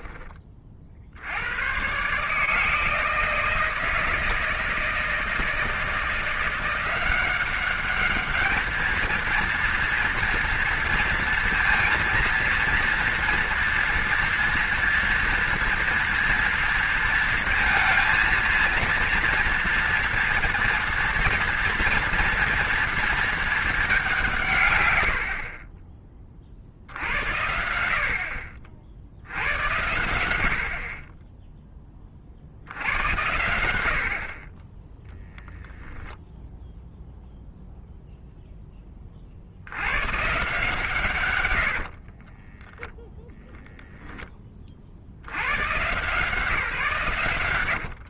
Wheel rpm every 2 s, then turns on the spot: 40, 160, 170, 180, 220, 230, 230, 230, 230, 230, 230, 230, 120, 50, 60, 60, 70, 20, 0, 10, 150, 10, 40, 130.
42-44